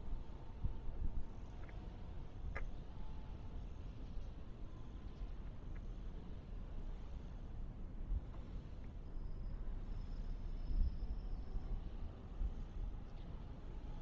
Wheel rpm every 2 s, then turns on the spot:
0, 0, 0, 0, 0, 0, 0.
none